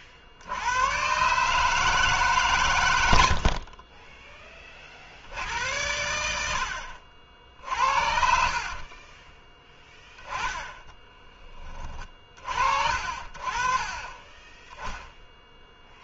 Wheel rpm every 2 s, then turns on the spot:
90, 150, 40, 60, 60, 20, 40, 10.
8-12